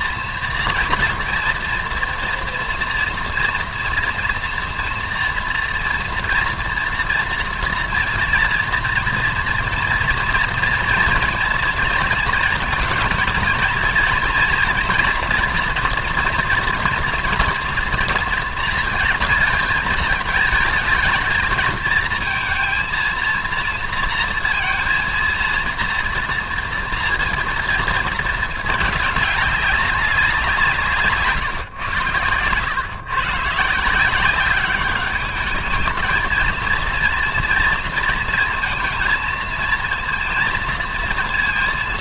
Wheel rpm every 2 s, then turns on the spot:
230, 230, 230, 240, 240, 230, 230, 240, 230, 220, 220, 230, 230, 230, 210, 150, 120, 210, 230, 230, 230.
none